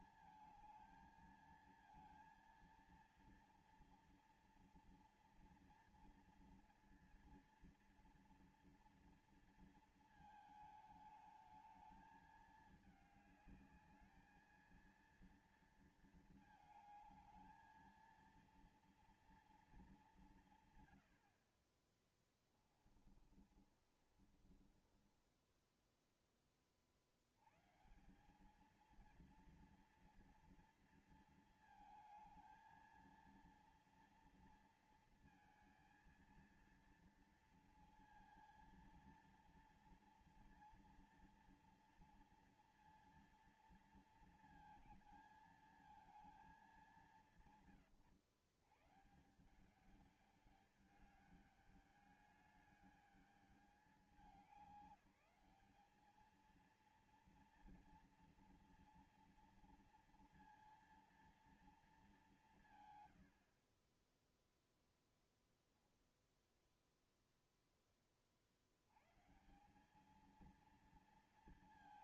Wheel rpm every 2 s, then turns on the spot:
220, 230, 230, 240, 230, 230, 220, 220, 230, 220, 180, 30, 30, 20, 170, 230, 220, 230, 230, 230, 230, 230, 230, 220, 130, 200, 210, 200, 220, 230, 230, 200, 20, 10, 30, 200.
22-26